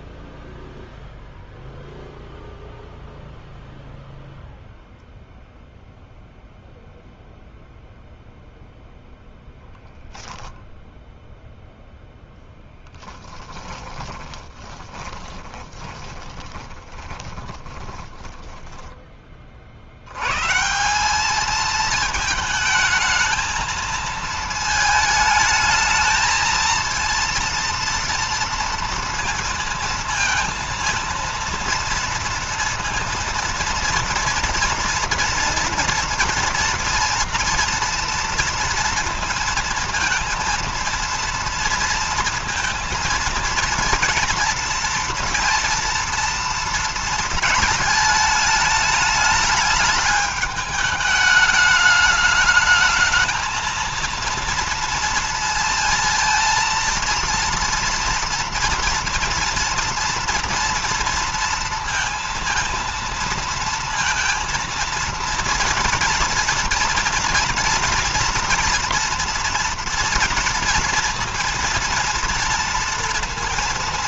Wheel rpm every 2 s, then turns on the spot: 0, 0, 0, 0, 10, 10, 10, 20, 20, 10, 160, 220, 220, 230, 230, 230, 230, 230, 230, 230, 230, 230, 230, 230, 210, 210, 220, 230, 230, 230, 230, 230, 230, 230, 230, 230, 230.
14-20